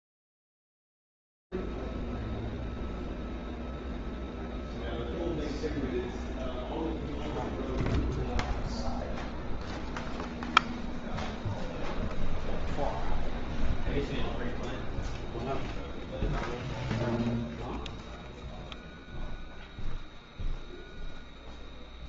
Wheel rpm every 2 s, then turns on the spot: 0, 0, 0, 0, 0, 0, 0, 0, 0, 0, 0.
none